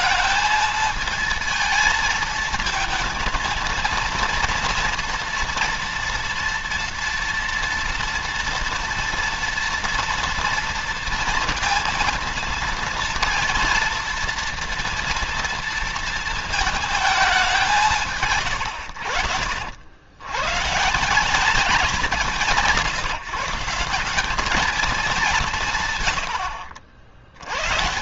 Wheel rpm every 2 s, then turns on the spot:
220, 220, 230, 240, 230, 230, 230, 230, 220, 80, 150, 180, 210, 70.
none